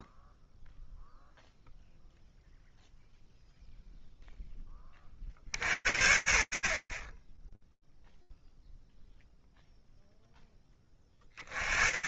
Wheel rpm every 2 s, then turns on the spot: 0, 0, 0, 80, 0, 10.
none